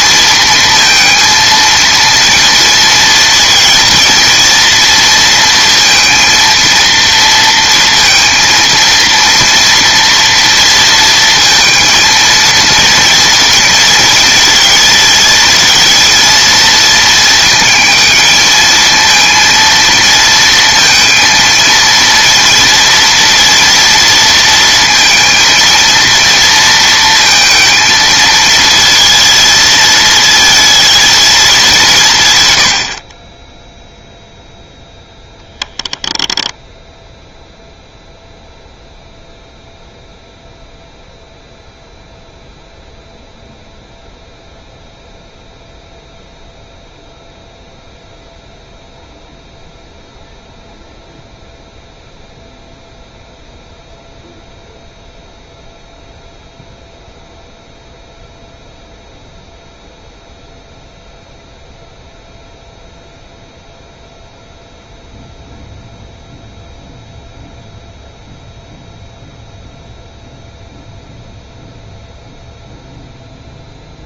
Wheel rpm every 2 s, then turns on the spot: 230, 230, 230, 230, 230, 230, 230, 230, 230, 220, 230, 230, 230, 230, 220, 220, 60, 0, 10, 0, 0, 0, 0, 0, 0, 0, 0, 0, 0, 0, 0, 0, 0, 0, 0, 0, 0.
none